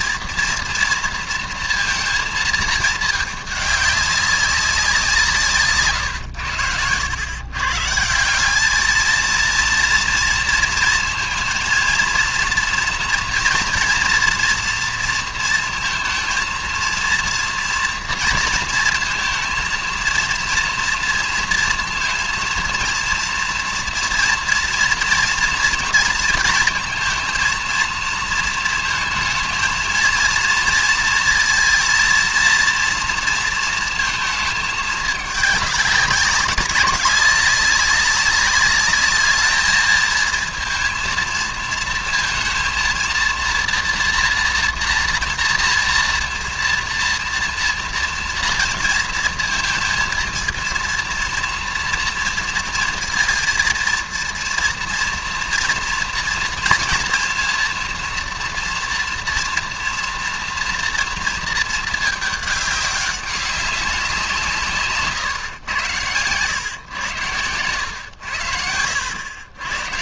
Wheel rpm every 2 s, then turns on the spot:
230, 220, 180, 90, 210, 230, 230, 230, 230, 230, 230, 230, 230, 220, 230, 230, 230, 220, 190, 200, 230, 230, 230, 230, 240, 230, 230, 230, 230, 230, 230, 210, 160, 120, 80.
none